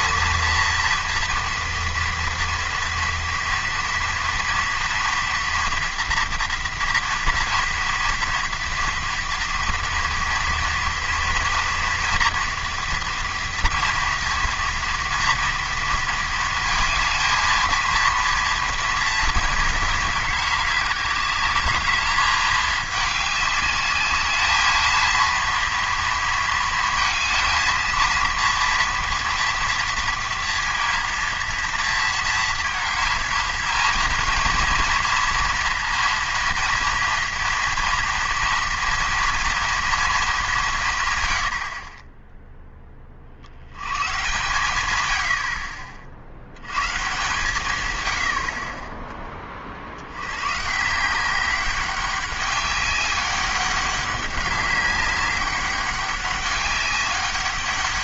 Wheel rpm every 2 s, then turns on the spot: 230, 230, 230, 230, 230, 230, 230, 230, 220, 230, 210, 210, 220, 230, 240, 230, 230, 230, 240, 230, 170, 10, 110, 90, 40, 130, 200, 200, 200.
none